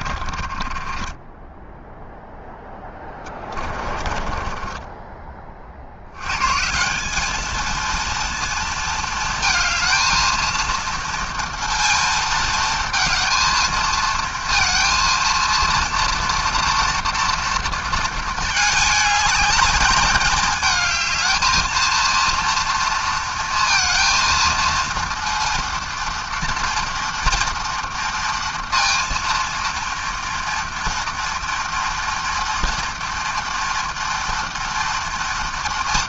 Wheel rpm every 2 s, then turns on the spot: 30, 0, 20, 120, 230, 230, 230, 230, 230, 220, 220, 230, 230, 230, 230, 230, 230, 230.
0-2 4-6